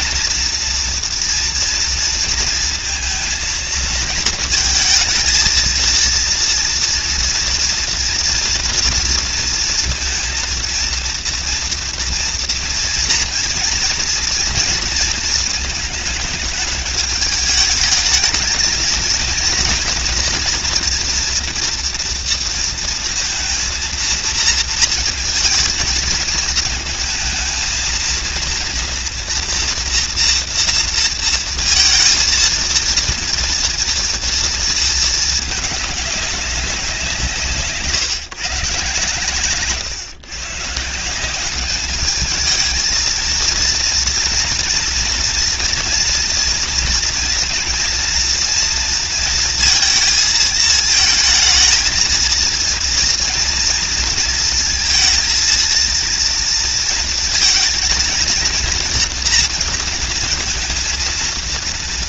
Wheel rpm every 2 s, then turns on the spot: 240, 230, 230, 230, 240, 230, 230, 230, 210, 220, 230, 230, 230, 230, 230, 230, 230, 230, 190, 130, 140, 220, 230, 240, 230, 230, 230, 230, 230, 230, 230.
none